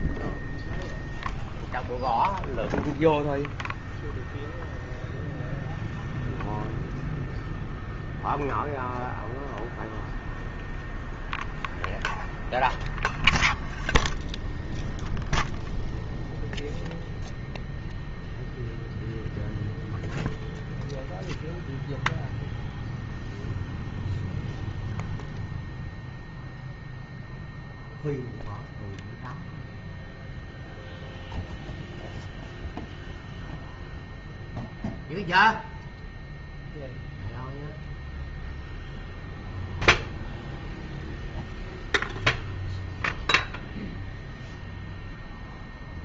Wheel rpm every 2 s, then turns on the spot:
0, 0, 0, 0, 0, 0, 0, 0, 0, 0, 0, 0, 0, 0, 0, 0, 0, 0, 0, 0, 0, 0, 0.
none